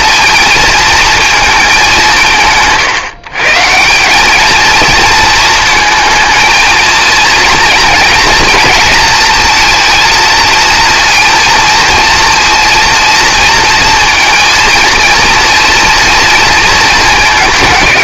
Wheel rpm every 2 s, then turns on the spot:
230, 150, 220, 230, 220, 230, 230, 230, 220.
none